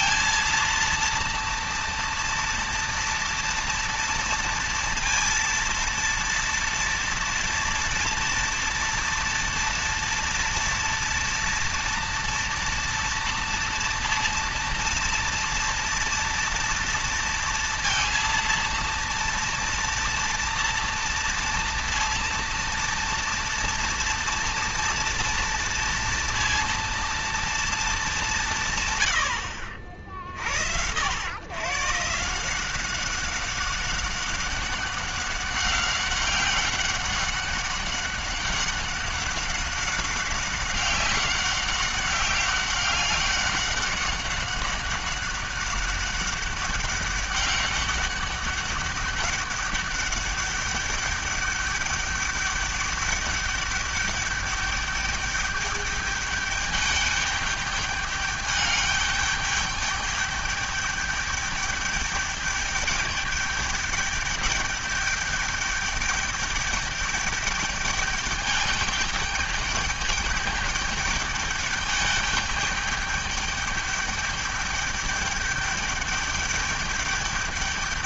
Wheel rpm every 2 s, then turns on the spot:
230, 230, 230, 230, 230, 230, 230, 230, 230, 230, 230, 230, 240, 230, 180, 70, 160, 190, 190, 190, 190, 200, 200, 200, 200, 200, 210, 200, 210, 210, 210, 210, 210, 210, 210, 210, 210, 210, 210.
none